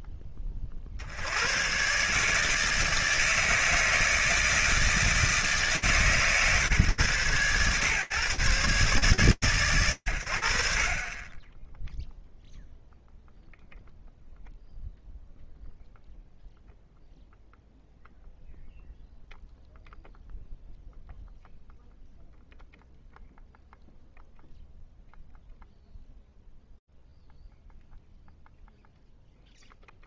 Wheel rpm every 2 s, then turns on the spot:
40, 160, 160, 130, 130, 30, 0, 0, 0, 0, 0, 0, 0, 0, 0.
none